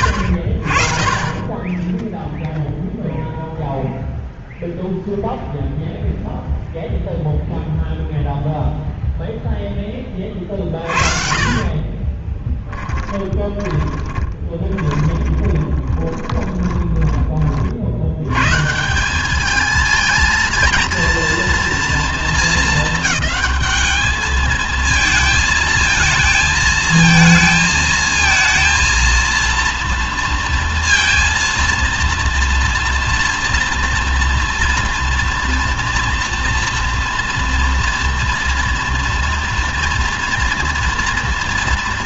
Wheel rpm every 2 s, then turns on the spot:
60, 0, 0, 0, 0, 30, 20, 20, 20, 180, 230, 220, 220, 220, 230, 230, 230, 230, 230, 230, 230.
10-18